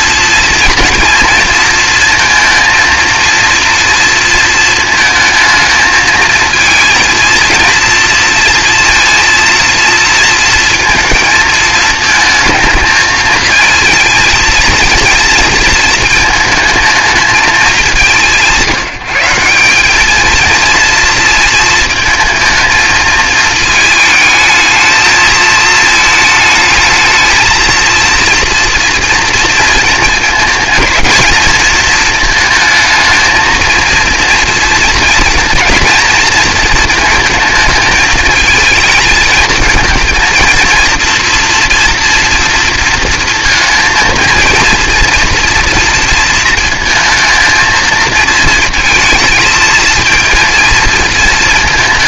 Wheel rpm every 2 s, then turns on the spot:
230, 230, 230, 230, 230, 230, 220, 230, 220, 180, 230, 220, 220, 220, 240, 220, 220, 230, 230, 220, 230, 230, 230, 230, 230, 230.
none